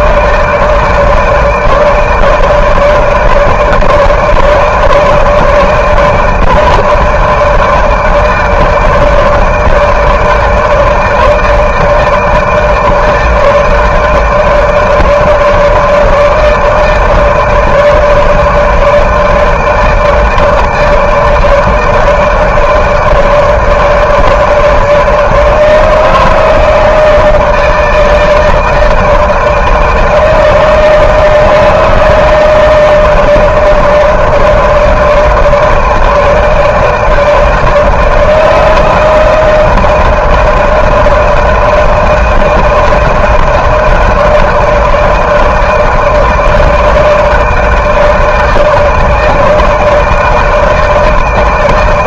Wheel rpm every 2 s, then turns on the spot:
160, 160, 150, 150, 150, 160, 160, 160, 150, 150, 150, 150, 150, 160, 160, 160, 160, 160, 160, 160, 160, 160, 160, 160, 160, 160.
none